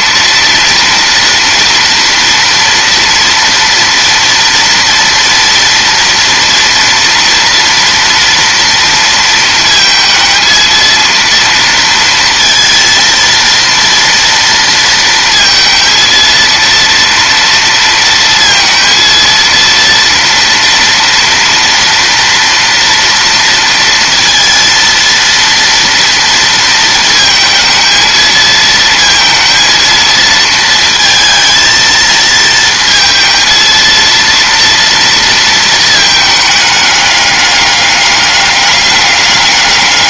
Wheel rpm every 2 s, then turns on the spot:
230, 230, 240, 230, 230, 220, 230, 230, 230, 230, 230, 230, 230, 230, 230, 230, 220, 230, 210, 200.
none